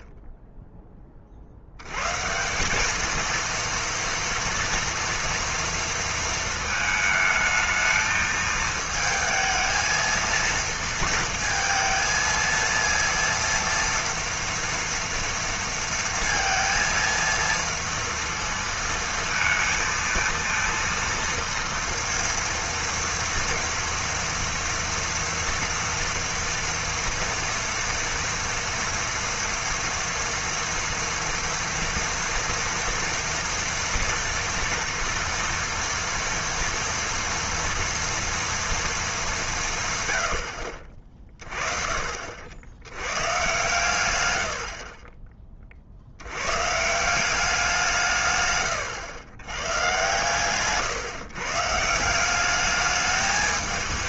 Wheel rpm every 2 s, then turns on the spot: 10, 180, 230, 220, 220, 230, 230, 230, 230, 230, 230, 230, 230, 230, 230, 230, 230, 230, 230, 230, 70, 80, 60, 130, 130, 130, 200.
48-50